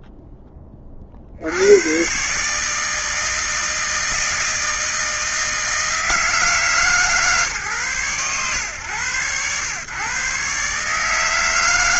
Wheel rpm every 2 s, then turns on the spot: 10, 140, 160, 150, 110, 130.
none